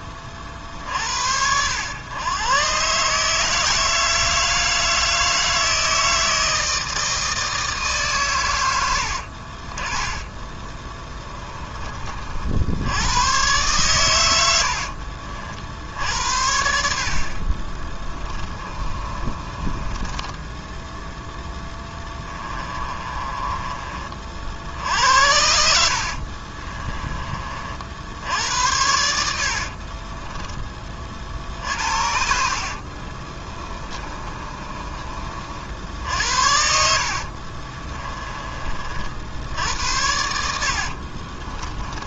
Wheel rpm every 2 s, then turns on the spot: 50, 140, 160, 160, 80, 20, 100, 60, 50, 30, 10, 30, 70, 30, 90, 40, 40, 30, 60, 50, 60.
10-12 14-16 18-20 22-24 26-30 32-34 36-38 40-42